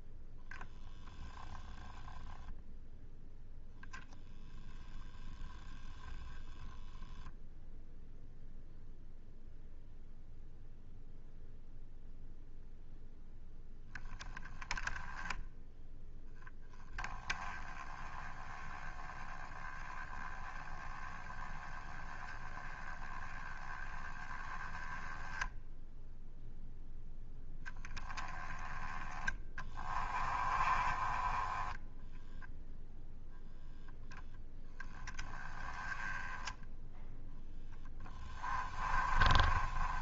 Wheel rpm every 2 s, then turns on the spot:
0, 0, 0, 0, 0, 0, 0, 10, 10, 10, 10, 10, 10, 0, 10, 20, 0, 10, 0, 20.
30-32 38-40